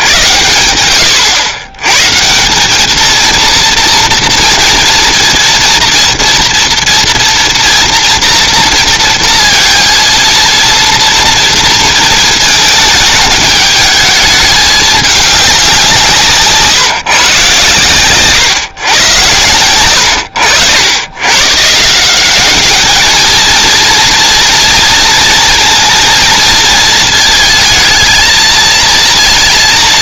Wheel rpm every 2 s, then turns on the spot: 70, 150, 230, 230, 230, 220, 230, 210, 160, 120, 100, 190, 230, 230, 220.
none